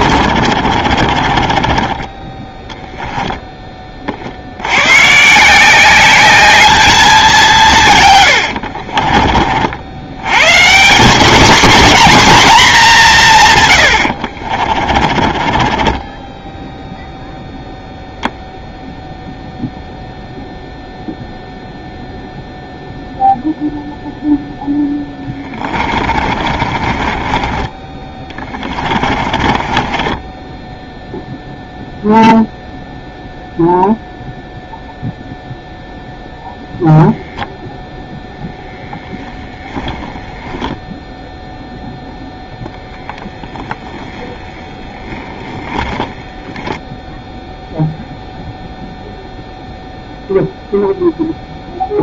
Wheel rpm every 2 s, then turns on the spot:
30, 10, 150, 190, 50, 230, 130, 30, 0, 0, 0, 0, 10, 30, 30, 0, 0, 0, 0, 0, 10, 0, 10, 10, 0, 0.
0-2 14-16 24-30